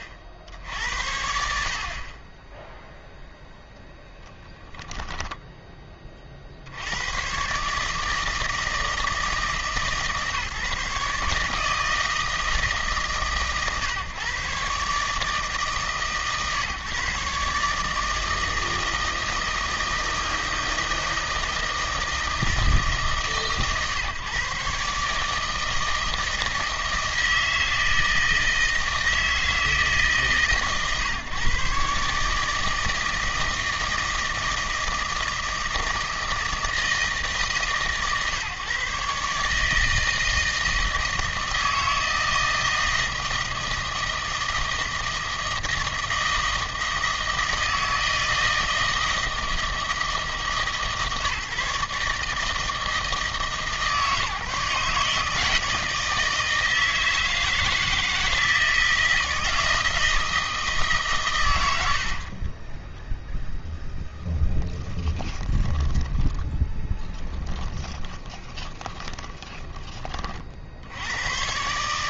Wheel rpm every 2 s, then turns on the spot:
80, 0, 20, 70, 160, 150, 150, 140, 140, 160, 160, 150, 140, 160, 160, 130, 160, 160, 160, 140, 160, 160, 160, 160, 160, 140, 160, 150, 160, 160, 150, 20, 10, 10, 20, 60.
4-6 64-70